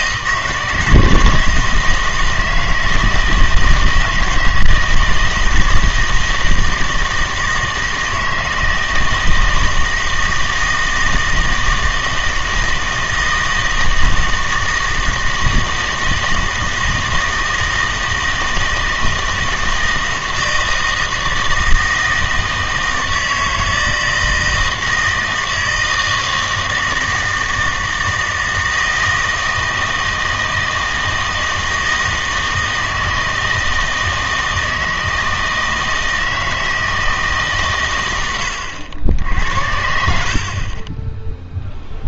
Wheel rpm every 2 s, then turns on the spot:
160, 160, 160, 160, 160, 160, 160, 160, 160, 160, 160, 160, 160, 160, 160, 160, 160, 160, 160, 90, 40.
none